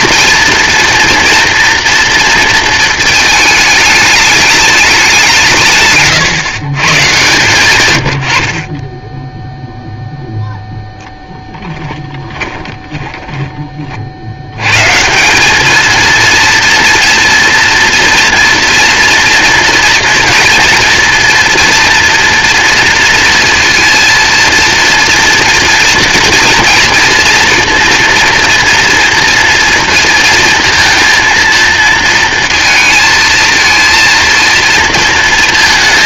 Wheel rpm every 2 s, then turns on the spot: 230, 230, 200, 110, 40, 0, 10, 110, 230, 230, 230, 230, 230, 240, 230, 230, 230, 230.
12-14